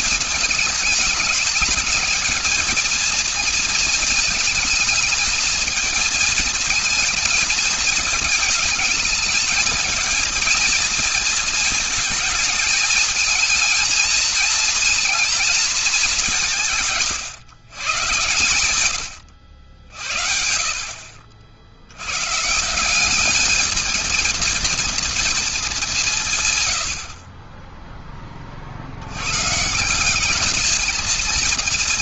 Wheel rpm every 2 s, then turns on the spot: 220, 220, 220, 220, 220, 230, 220, 230, 190, 110, 60, 140, 230, 130, 40, 210.
26-28